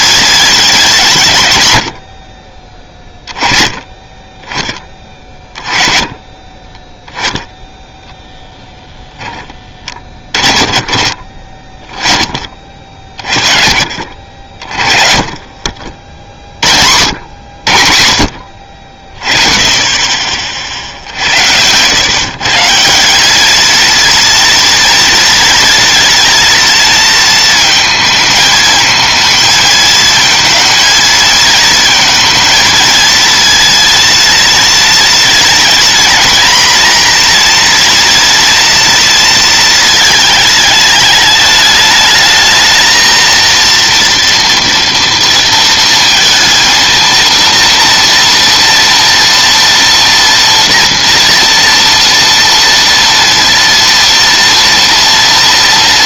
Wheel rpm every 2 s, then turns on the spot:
90, 20, 20, 0, 20, 30, 40, 40, 70, 40, 60, 180, 240, 230, 220, 220, 230, 230, 240, 230, 220, 230, 230, 230, 230, 230, 230, 240.
8-10